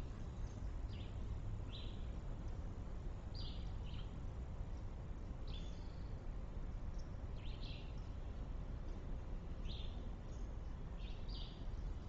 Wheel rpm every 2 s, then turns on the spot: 0, 0, 0, 0, 0, 0.
none